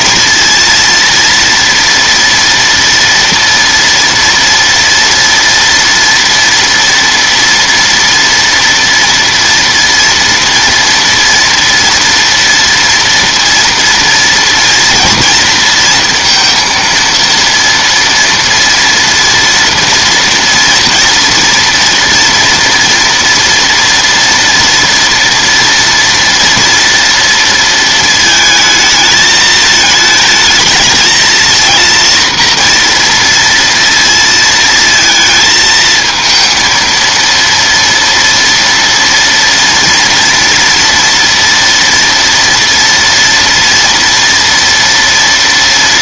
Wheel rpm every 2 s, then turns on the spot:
230, 230, 230, 230, 230, 230, 230, 230, 230, 230, 230, 230, 230, 230, 220, 220, 230, 220, 230, 230, 240, 230, 230.
none